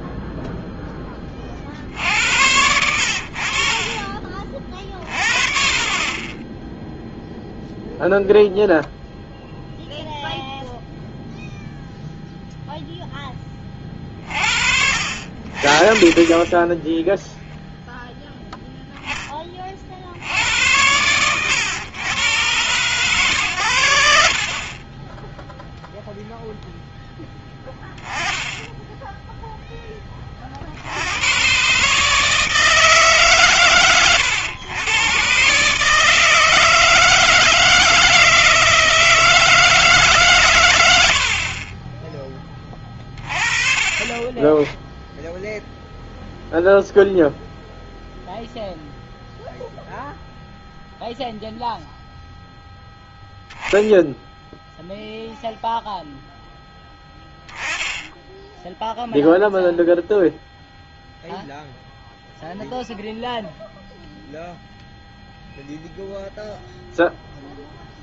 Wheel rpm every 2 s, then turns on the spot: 0, 70, 30, 10, 0, 0, 0, 50, 10, 0, 80, 120, 40, 0, 10, 40, 160, 110, 160, 160, 120, 20, 20, 0, 0, 0, 0, 0, 0, 10, 0, 0, 0, 0.
40-42